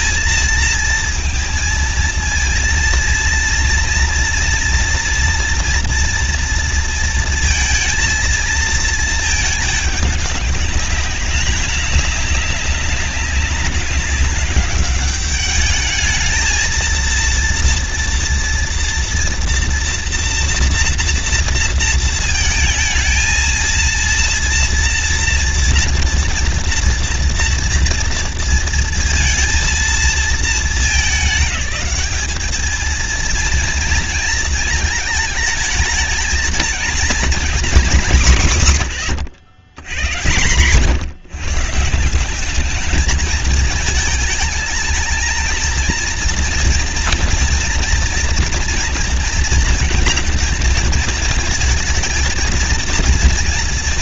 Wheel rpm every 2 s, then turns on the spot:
220, 230, 230, 230, 230, 200, 200, 200, 220, 230, 230, 220, 230, 230, 230, 220, 210, 220, 220, 180, 130, 190, 210, 230, 230, 230, 230.
none